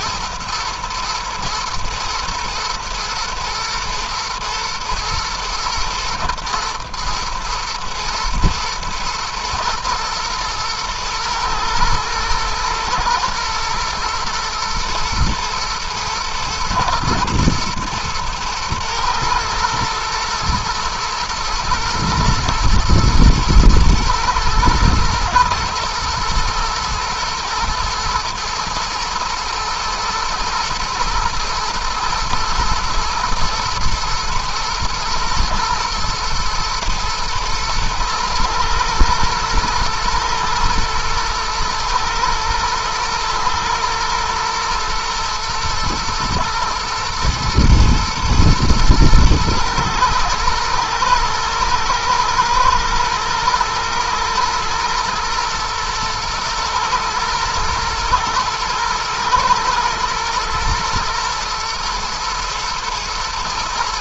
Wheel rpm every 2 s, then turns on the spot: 120, 110, 110, 110, 120, 110, 120, 110, 120, 120, 110, 120, 110, 110, 120, 120, 120, 120, 110, 110, 120, 110, 120, 110, 110, 110, 110, 120, 120, 120, 120, 110.
none